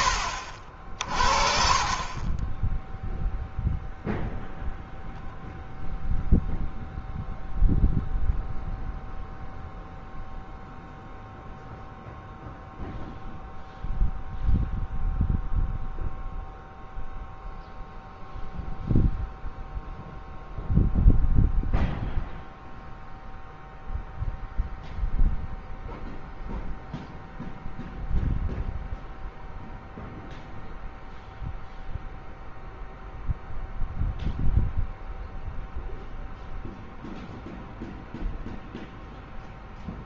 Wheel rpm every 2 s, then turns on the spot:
50, 10, 0, 0, 0, 0, 0, 0, 0, 0, 0, 0, 0, 0, 0, 0, 0, 0, 0, 0.
none